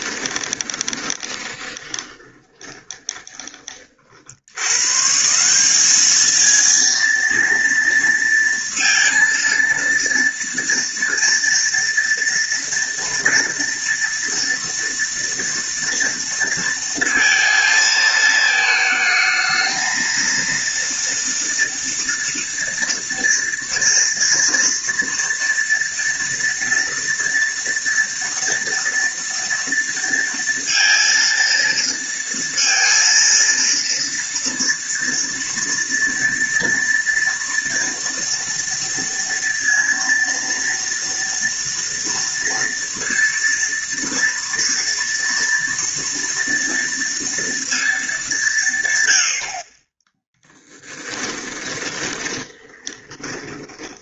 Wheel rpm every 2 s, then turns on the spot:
20, 20, 120, 230, 230, 230, 230, 240, 230, 220, 230, 230, 230, 230, 230, 230, 230, 230, 230, 230, 230, 230, 230, 230, 130, 10, 20.
0-4 50-54